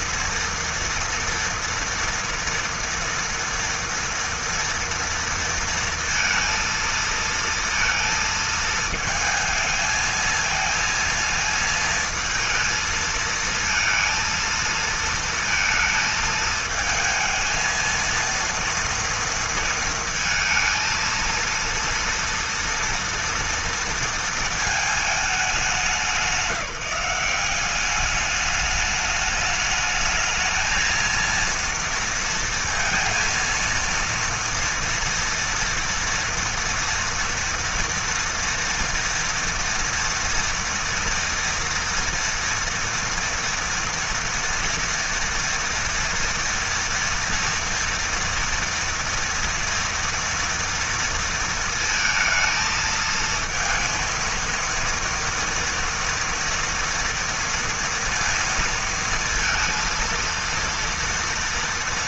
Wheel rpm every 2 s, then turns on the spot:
240, 230, 230, 230, 220, 230, 230, 230, 220, 230, 230, 230, 220, 180, 210, 220, 230, 230, 230, 230, 230, 230, 240, 230, 230, 230, 220, 230, 230, 230, 230.
none